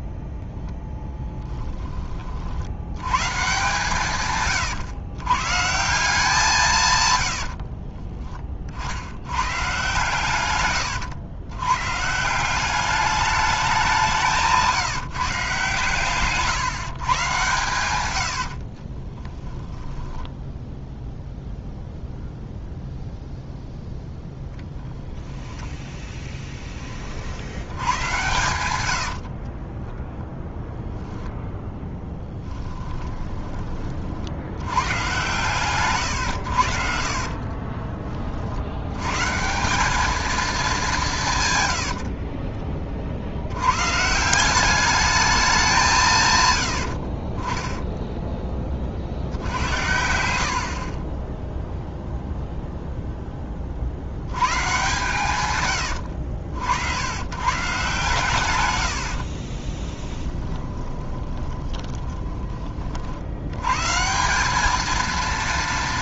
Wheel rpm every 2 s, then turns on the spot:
0, 80, 130, 150, 50, 110, 200, 160, 150, 30, 0, 0, 10, 10, 100, 0, 10, 100, 70, 90, 200, 40, 200, 90, 40, 50, 0, 110, 70, 100, 20, 30, 210.
18-20 32-34 50-52 60-62